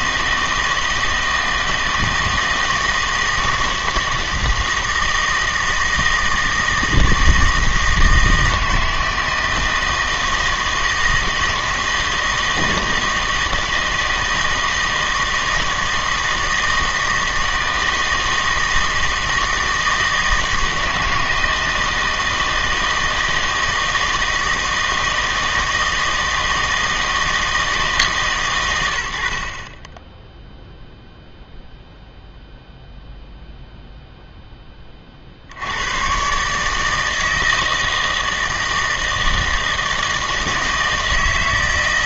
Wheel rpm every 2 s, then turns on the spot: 160, 160, 160, 160, 160, 160, 160, 160, 160, 160, 160, 160, 160, 160, 100, 0, 0, 10, 140, 160, 160.
none